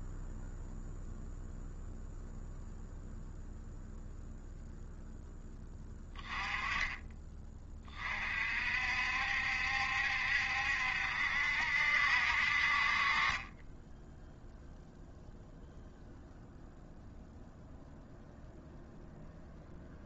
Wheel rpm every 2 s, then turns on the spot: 0, 0, 0, 20, 50, 70, 50, 0, 0, 0.
none